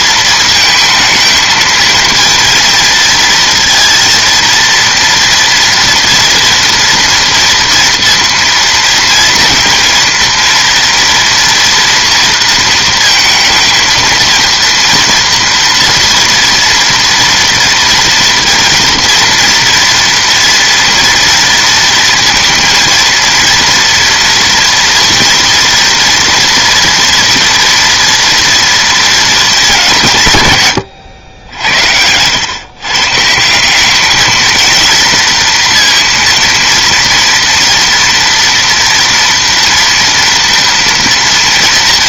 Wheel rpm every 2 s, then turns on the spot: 220, 230, 230, 240, 230, 230, 230, 230, 230, 230, 230, 230, 230, 230, 230, 140, 120, 220, 230, 230, 230.
none